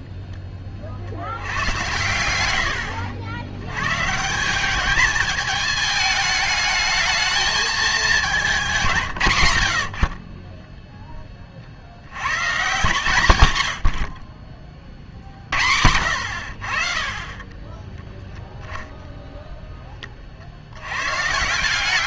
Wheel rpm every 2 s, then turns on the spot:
40, 80, 190, 220, 190, 20, 130, 30, 50, 0, 70.
8-10